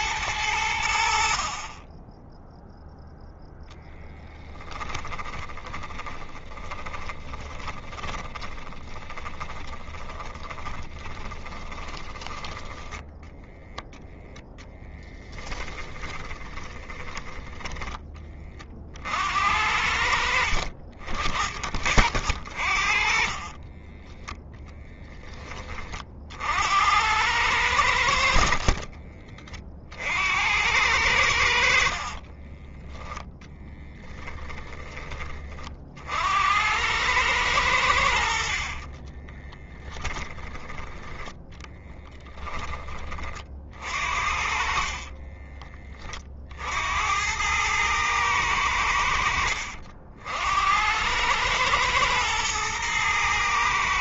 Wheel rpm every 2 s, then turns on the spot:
70, 0, 10, 10, 20, 30, 10, 10, 10, 50, 50, 40, 10, 80, 50, 90, 20, 20, 100, 40, 10, 30, 40, 80, 80, 80, 110.
4-12 14-16 22-24 28-30 38-40 44-46